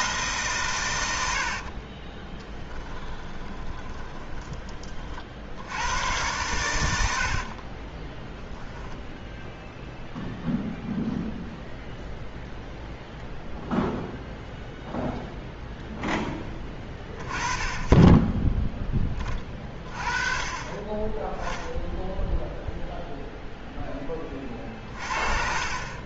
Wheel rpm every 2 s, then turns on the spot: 130, 20, 20, 100, 10, 0, 0, 0, 20, 10, 30, 0, 40.
2-4